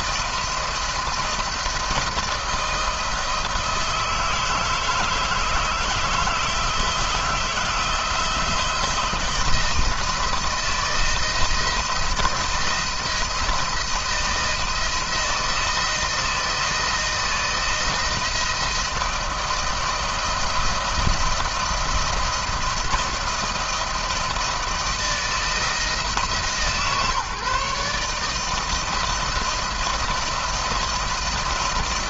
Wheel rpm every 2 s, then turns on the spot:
170, 160, 160, 160, 170, 160, 160, 170, 160, 160, 170, 170, 170, 140, 160, 160.
none